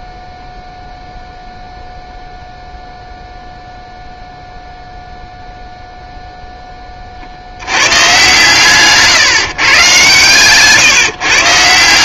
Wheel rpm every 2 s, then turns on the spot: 0, 0, 0, 10, 140, 140.
none